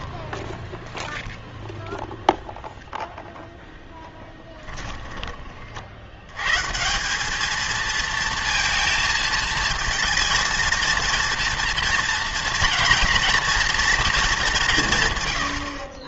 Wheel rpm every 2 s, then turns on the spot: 0, 0, 10, 150, 230, 230, 240, 170.
4-6